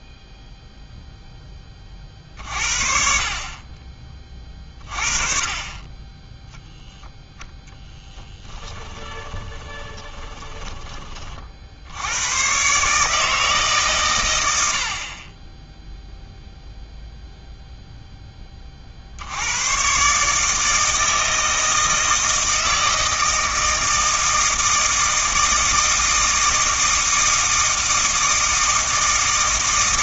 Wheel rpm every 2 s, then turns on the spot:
0, 50, 30, 0, 10, 20, 140, 80, 0, 50, 160, 160, 160, 160, 160.
8-10